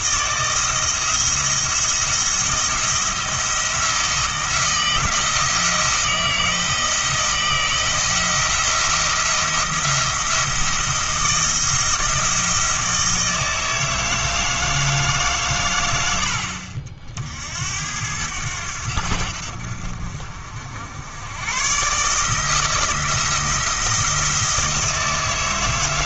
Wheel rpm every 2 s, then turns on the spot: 160, 170, 170, 170, 170, 170, 160, 160, 60, 80, 80, 160, 160.
none